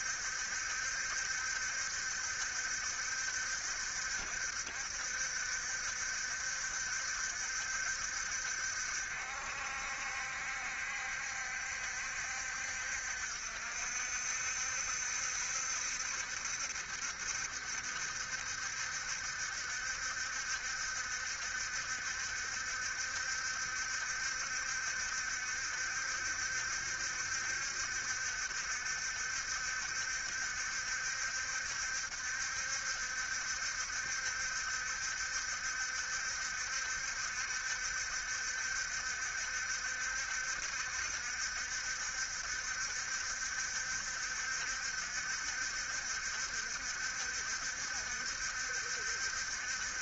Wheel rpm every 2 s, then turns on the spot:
70, 70, 60, 70, 60, 60, 60, 70, 70, 70, 70, 70, 70, 70, 70, 70, 70, 70, 70, 70, 60, 60, 60, 70, 70.
none